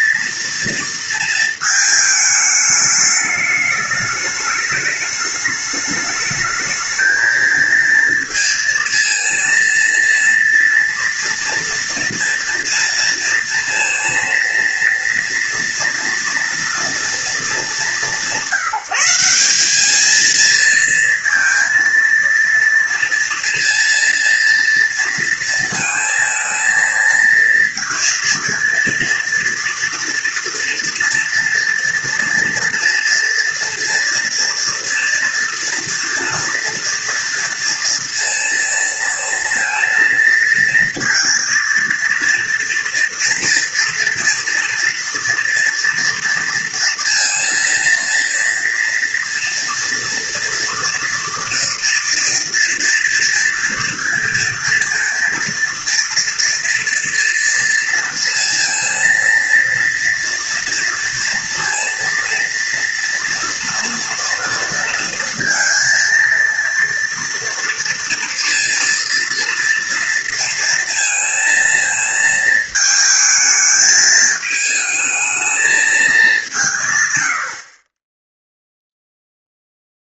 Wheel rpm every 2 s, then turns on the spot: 230, 210, 210, 220, 230, 230, 230, 230, 230, 170, 230, 230, 230, 230, 230, 230, 230, 230, 230, 230, 230, 230, 230, 230, 230, 230, 230, 230, 230, 230, 230, 230, 230, 230, 230, 230, 220, 220, 180, 0.
none